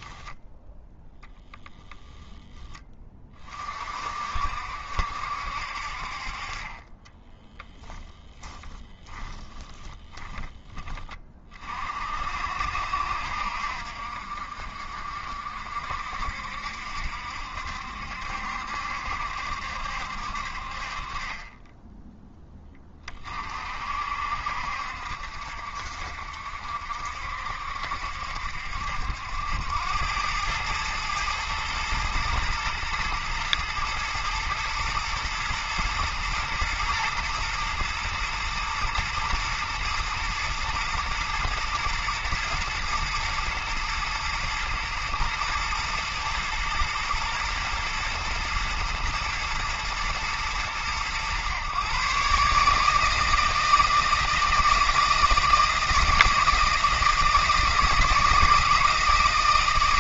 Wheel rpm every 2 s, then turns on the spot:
0, 20, 60, 20, 10, 20, 60, 50, 70, 70, 40, 20, 60, 60, 70, 110, 110, 110, 120, 120, 120, 110, 120, 110, 110, 110, 150, 160, 160, 160.
6-10